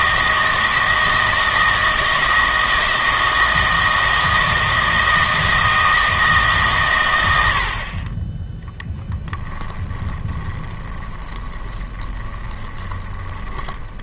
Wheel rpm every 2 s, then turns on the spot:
160, 160, 160, 130, 10, 20, 20.
8-14